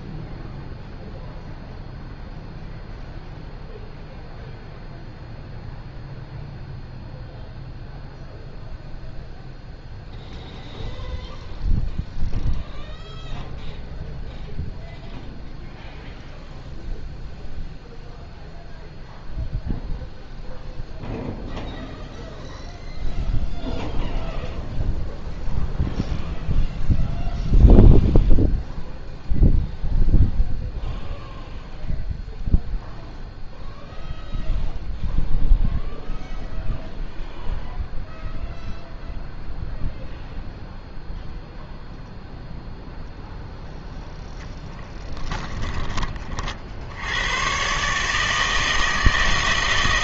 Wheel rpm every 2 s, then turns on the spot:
0, 0, 0, 0, 0, 0, 0, 0, 0, 0, 0, 0, 0, 0, 0, 0, 0, 0, 0, 0, 0, 0, 10, 70, 160.
none